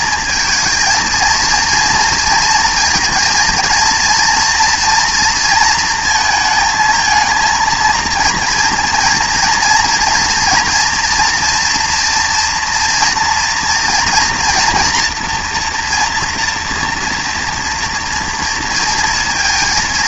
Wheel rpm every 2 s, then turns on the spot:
230, 230, 230, 220, 230, 230, 230, 230, 230, 230.
none